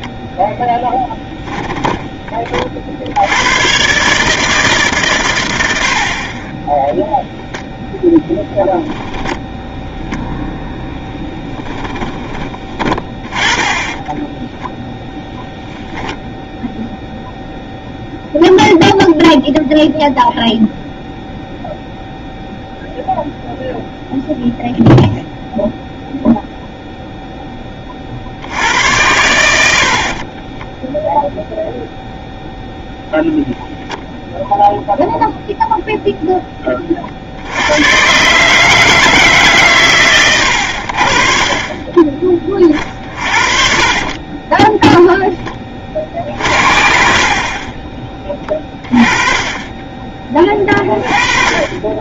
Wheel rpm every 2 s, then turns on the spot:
0, 30, 150, 20, 0, 0, 20, 10, 0, 0, 0, 0, 0, 0, 80, 10, 0, 0, 10, 140, 80, 30, 10, 50, 20, 30.
14-16 30-32